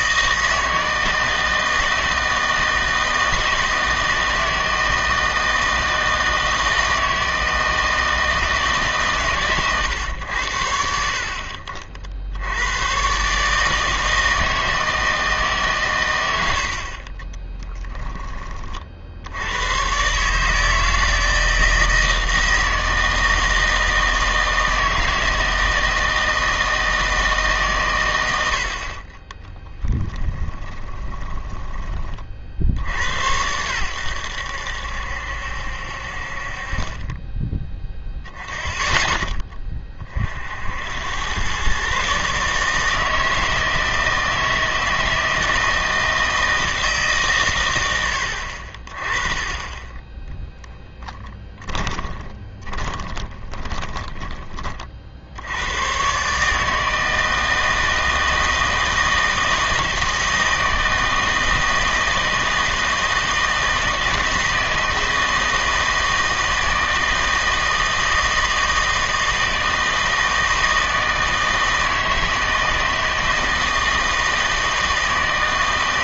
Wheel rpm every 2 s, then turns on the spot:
160, 160, 160, 160, 150, 70, 100, 160, 50, 40, 160, 160, 160, 160, 60, 20, 70, 70, 30, 0, 70, 150, 160, 160, 40, 10, 30, 40, 150, 160, 160, 160, 160, 160, 160, 160, 160, 160.
16-18 30-32 50-54